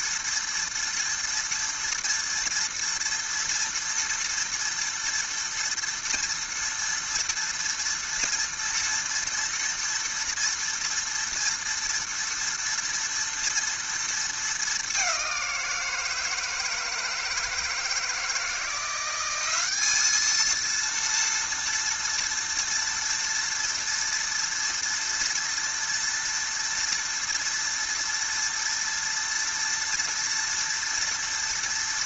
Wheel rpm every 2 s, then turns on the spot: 230, 230, 230, 230, 230, 230, 230, 220, 160, 160, 230, 230, 230, 230, 230, 230.
none